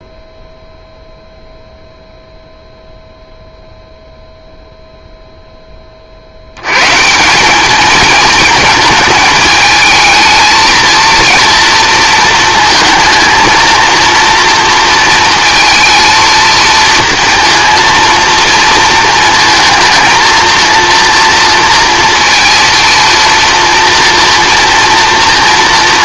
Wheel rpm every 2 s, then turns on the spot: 0, 0, 0, 100, 220, 220, 220, 230, 230, 230, 230, 230, 230.
none